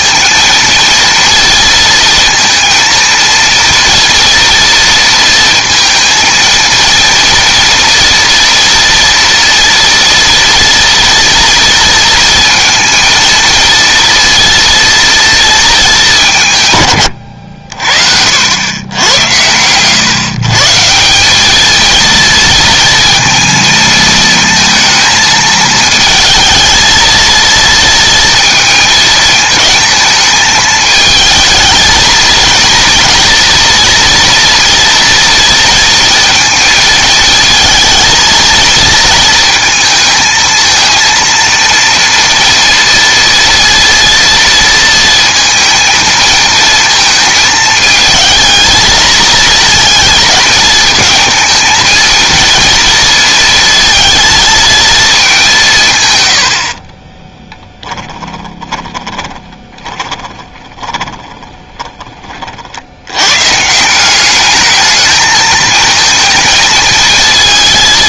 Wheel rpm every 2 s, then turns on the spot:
230, 230, 230, 230, 230, 230, 230, 230, 130, 90, 150, 230, 230, 220, 220, 220, 230, 230, 220, 230, 230, 230, 230, 230, 230, 220, 230, 230, 50, 20, 10, 60, 220, 220.
56-62